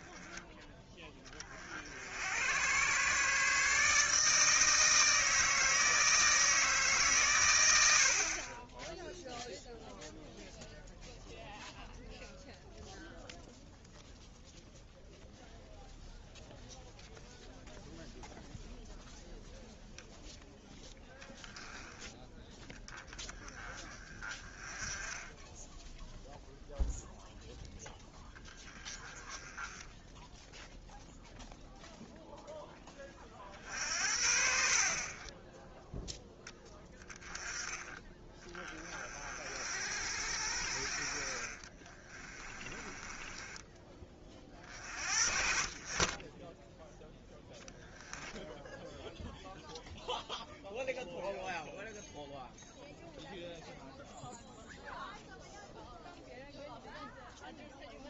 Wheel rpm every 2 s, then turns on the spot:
10, 100, 160, 160, 20, 0, 0, 0, 0, 0, 0, 10, 20, 0, 10, 0, 10, 50, 20, 30, 60, 20, 40, 10, 0, 0, 0, 0, 0.
42-44